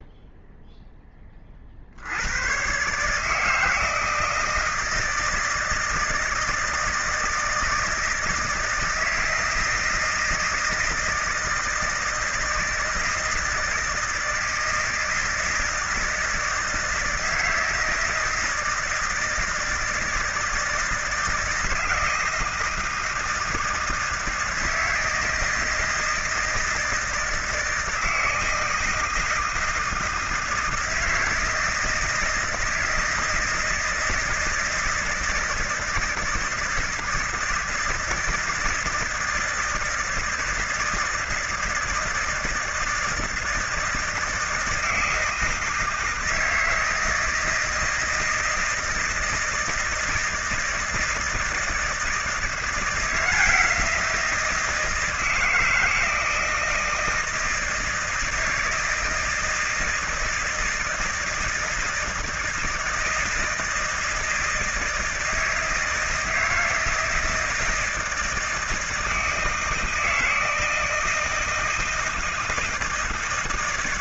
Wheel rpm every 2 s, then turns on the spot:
10, 130, 160, 160, 160, 160, 160, 160, 160, 160, 160, 170, 160, 160, 160, 160, 170, 160, 160, 160, 160, 160, 160, 160, 160, 160, 170, 160, 160, 160, 160, 160, 160, 160, 160, 160, 160.
none